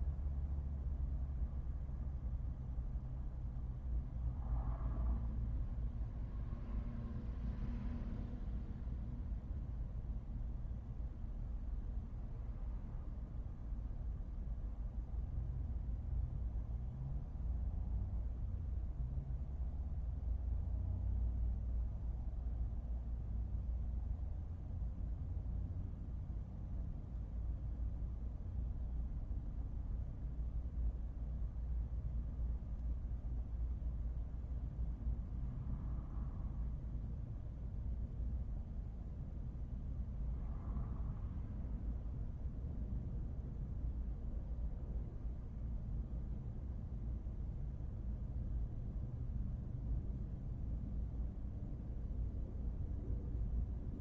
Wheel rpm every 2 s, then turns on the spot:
0, 0, 0, 0, 0, 0, 0, 0, 0, 0, 0, 0, 0, 0, 0, 0, 0, 0, 0, 0, 0, 0, 0, 0, 0, 0, 0.
none